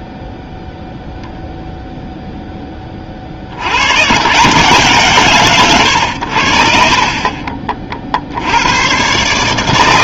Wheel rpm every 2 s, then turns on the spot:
0, 20, 150, 50, 80.
none